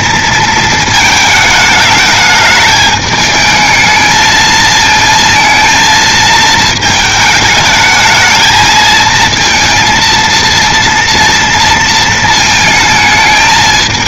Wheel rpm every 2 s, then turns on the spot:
230, 210, 220, 220, 220, 230, 230.
none